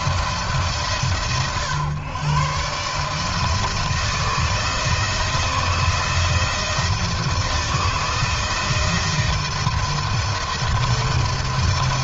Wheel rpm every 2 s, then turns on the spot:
120, 160, 160, 160, 160, 150.
none